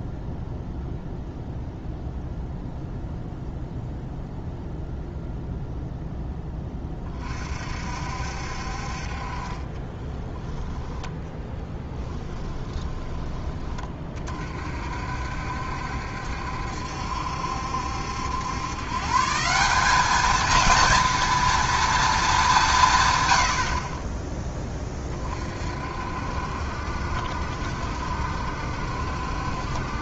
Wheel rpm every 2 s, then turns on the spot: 0, 0, 0, 20, 50, 20, 10, 50, 70, 130, 230, 150, 20, 60, 70.
12-14